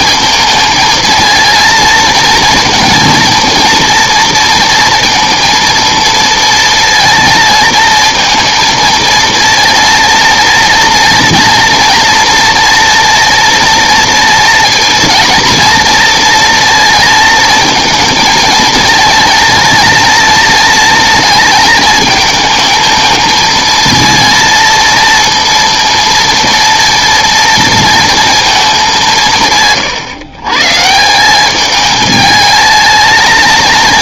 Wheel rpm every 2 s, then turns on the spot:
220, 230, 230, 230, 230, 230, 230, 230, 230, 220, 230, 220, 230, 230, 210, 140, 220.
none